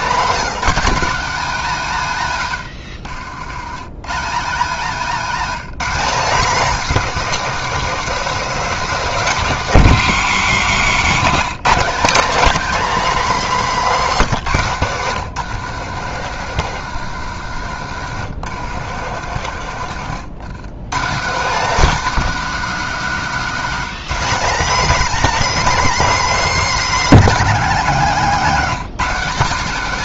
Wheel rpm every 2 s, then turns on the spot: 230, 110, 190, 250, 230, 170, 230, 150, 120, 110, 160, 230, 220, 230, 210.
14-20